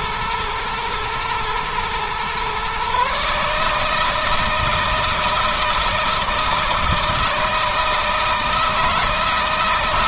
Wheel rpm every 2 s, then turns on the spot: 120, 140, 160, 160, 160.
none